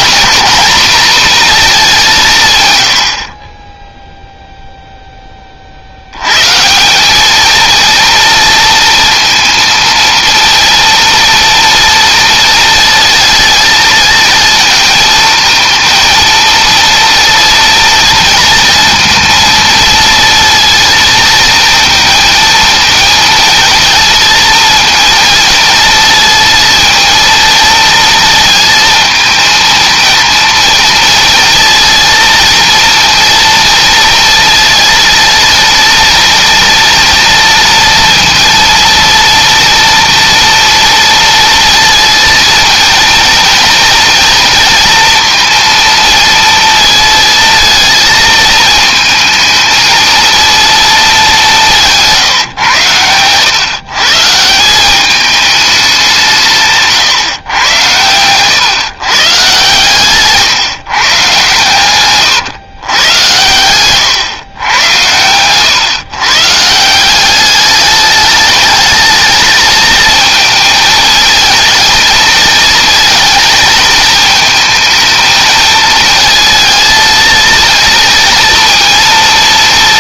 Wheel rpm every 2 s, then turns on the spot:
230, 100, 0, 160, 230, 230, 220, 230, 230, 230, 230, 230, 230, 230, 220, 230, 230, 230, 230, 230, 230, 230, 230, 230, 220, 230, 110, 180, 150, 120, 150, 120, 110, 150, 220, 220, 230, 220, 230, 230.
56-58